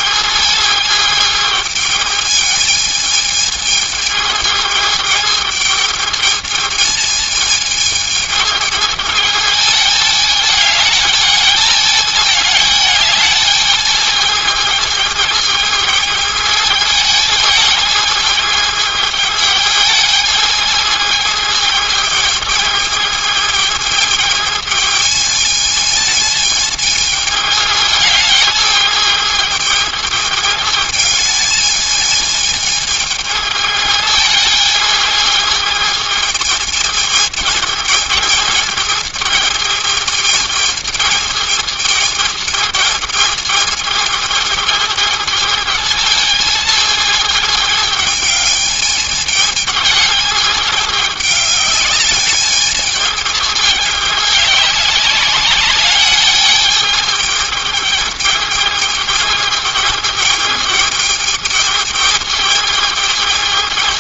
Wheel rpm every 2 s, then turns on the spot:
220, 220, 210, 220, 210, 210, 210, 220, 220, 220, 220, 220, 220, 220, 210, 210, 210, 220, 210, 220, 220, 220, 220, 220, 210, 210, 210, 200, 220, 220, 210, 210.
none